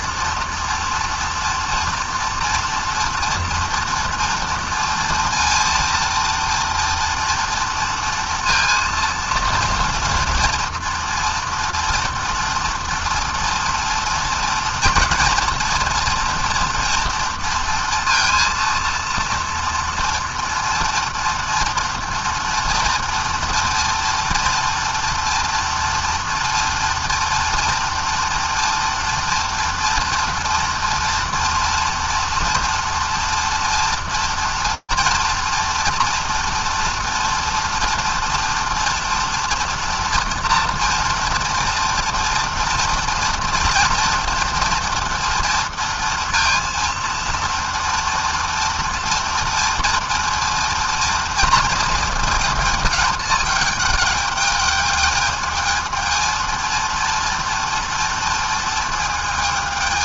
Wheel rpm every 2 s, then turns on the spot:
230, 230, 240, 230, 230, 230, 230, 230, 240, 230, 230, 230, 230, 230, 230, 230, 230, 240, 230, 230, 230, 230, 230, 230, 230, 230, 220, 210, 230, 230.
none